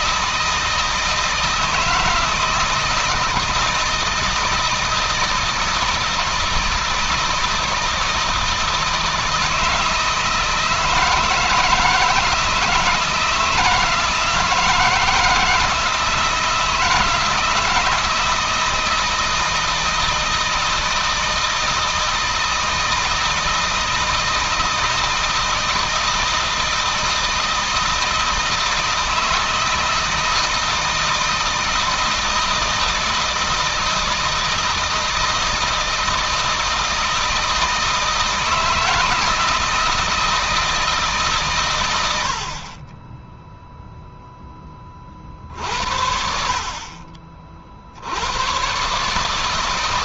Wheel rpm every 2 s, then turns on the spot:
160, 160, 160, 160, 160, 160, 160, 160, 170, 160, 160, 160, 160, 160, 160, 160, 160, 160, 160, 160, 160, 30, 10, 50, 110.
none